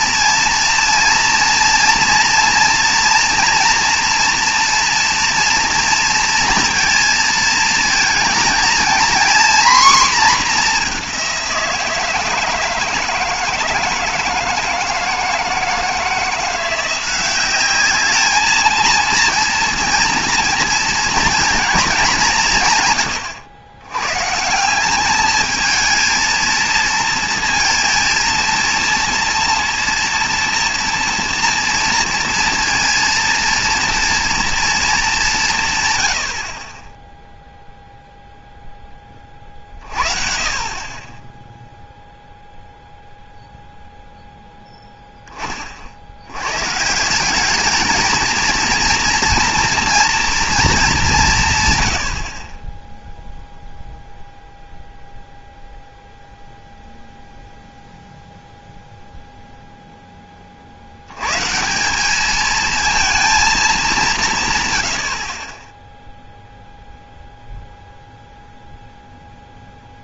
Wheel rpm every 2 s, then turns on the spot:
230, 230, 230, 230, 230, 220, 160, 160, 170, 220, 230, 170, 170, 230, 230, 230, 230, 230, 40, 0, 40, 0, 0, 120, 230, 230, 20, 0, 0, 0, 50, 220, 130, 0, 0.
none